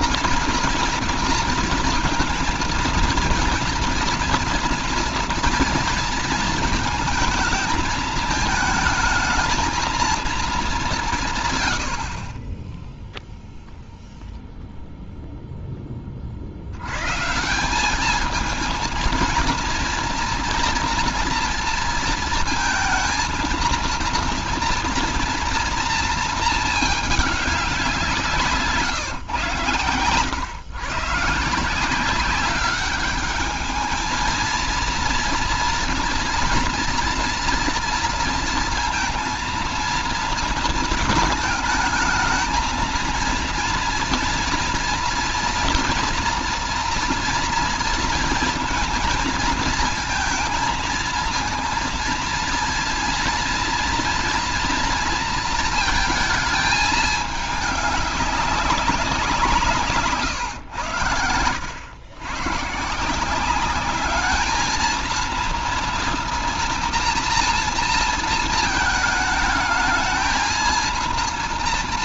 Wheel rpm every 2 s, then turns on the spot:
240, 230, 230, 230, 220, 220, 30, 0, 50, 220, 230, 220, 230, 220, 160, 120, 190, 230, 230, 230, 230, 220, 230, 230, 230, 230, 230, 230, 220, 200, 120, 120, 210, 240, 230, 220.
28-30